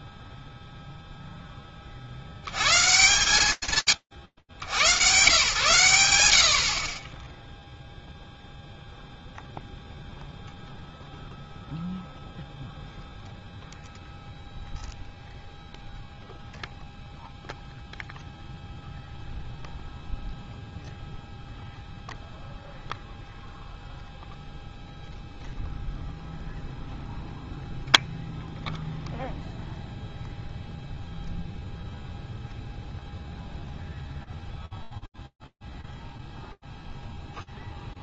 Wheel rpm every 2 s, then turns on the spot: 60, 60, 60, 80, 0, 0, 0, 0, 0, 0, 0, 0, 0, 0, 0, 0, 0, 0, 0.
none